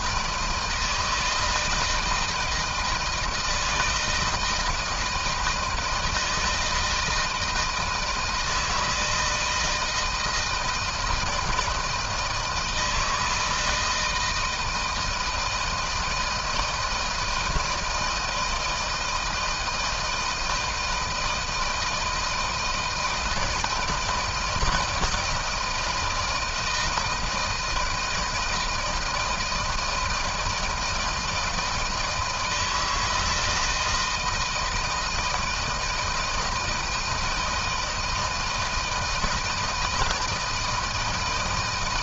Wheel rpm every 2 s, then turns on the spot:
160, 160, 160, 160, 160, 160, 160, 160, 160, 170, 160, 160, 160, 160, 160, 160, 170, 170, 160, 160, 160.
none